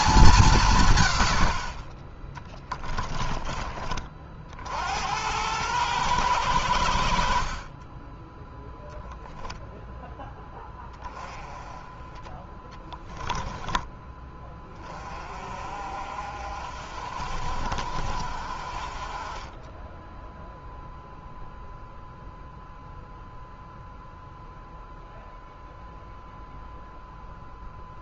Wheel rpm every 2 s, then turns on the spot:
150, 10, 60, 80, 0, 10, 10, 30, 50, 40, 0, 0, 0, 0.
2-4 12-14